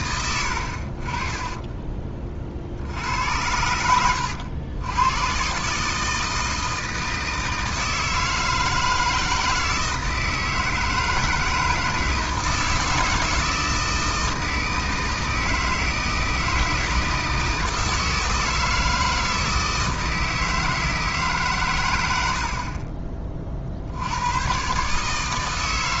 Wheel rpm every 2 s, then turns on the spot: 60, 60, 90, 160, 160, 160, 160, 160, 160, 160, 160, 40, 140.
0-2